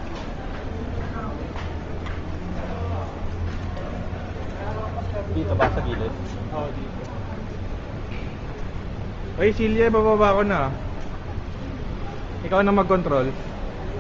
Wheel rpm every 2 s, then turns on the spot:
0, 0, 0, 0, 0, 0, 0.
none